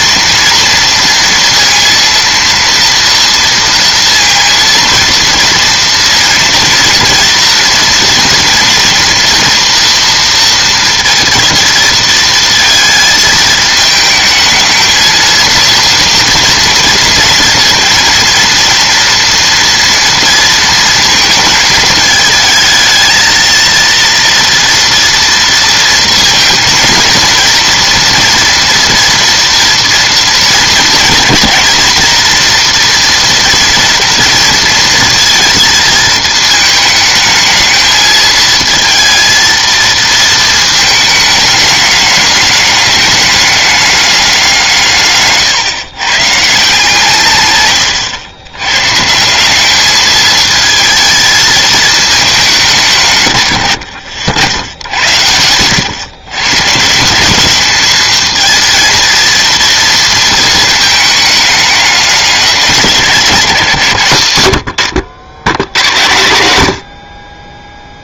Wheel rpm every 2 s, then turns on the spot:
230, 230, 230, 230, 230, 230, 220, 220, 230, 230, 230, 220, 230, 230, 230, 230, 230, 230, 220, 230, 220, 210, 180, 150, 120, 220, 170, 80, 130, 220, 220, 200, 90, 80.
none